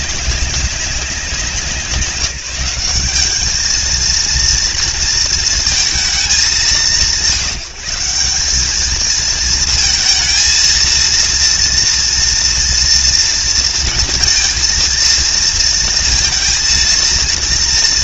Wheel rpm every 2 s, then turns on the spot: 200, 190, 230, 170, 210, 230, 240, 230, 230.
none